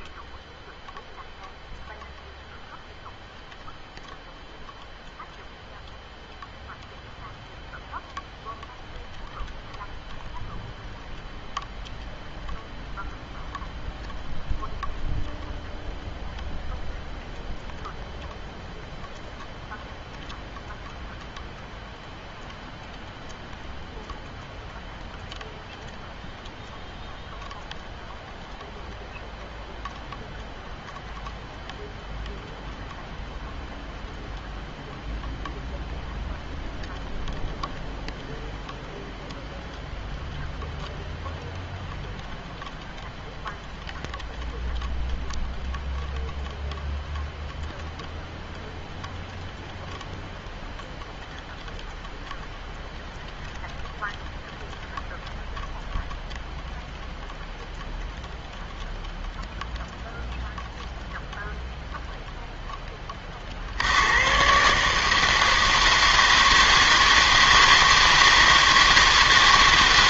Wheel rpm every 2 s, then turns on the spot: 0, 0, 0, 0, 0, 0, 0, 0, 0, 0, 0, 0, 0, 0, 0, 0, 0, 0, 0, 0, 0, 0, 0, 0, 0, 0, 0, 0, 0, 0, 0, 10, 140, 160, 160.
none